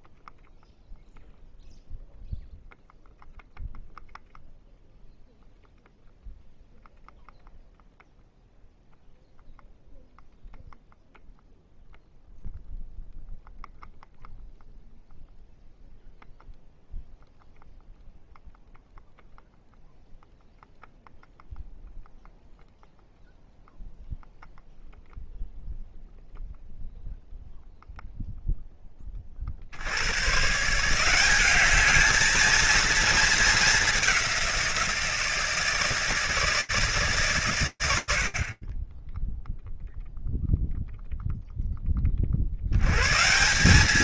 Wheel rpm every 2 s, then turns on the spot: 0, 0, 0, 0, 0, 0, 0, 0, 0, 0, 0, 0, 0, 0, 0, 140, 220, 180, 150, 30, 0, 70.
none